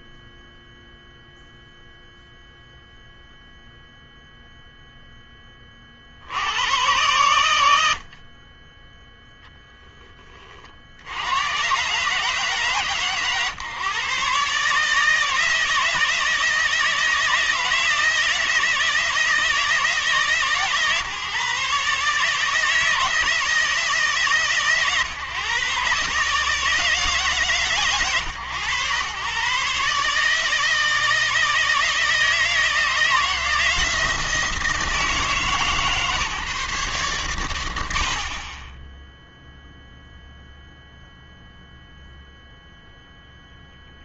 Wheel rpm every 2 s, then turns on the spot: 0, 0, 0, 100, 10, 60, 140, 150, 160, 160, 150, 160, 150, 150, 110, 160, 160, 160, 140, 20, 0, 0.
none